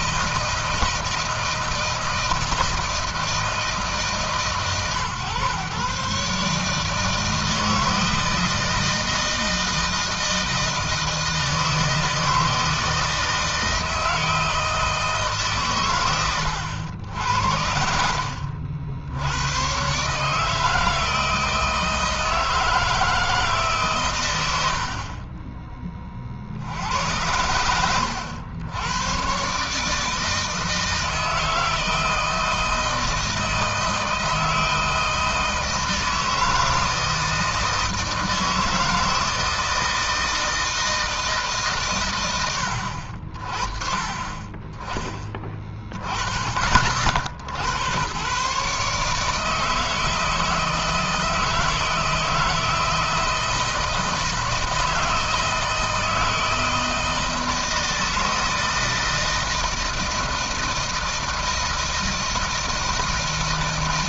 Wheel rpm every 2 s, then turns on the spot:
160, 160, 130, 150, 160, 160, 160, 160, 80, 60, 160, 170, 80, 70, 90, 160, 160, 160, 160, 160, 160, 90, 20, 40, 130, 160, 160, 160, 160, 160, 160, 160.
none